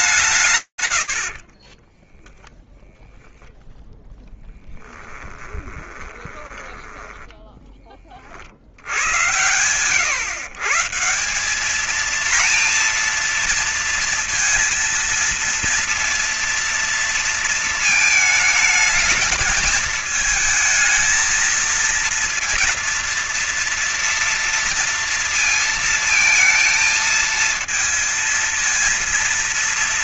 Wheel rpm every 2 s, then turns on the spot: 80, 10, 10, 10, 80, 160, 230, 230, 230, 220, 230, 230, 230, 230, 230.
0-2 4-8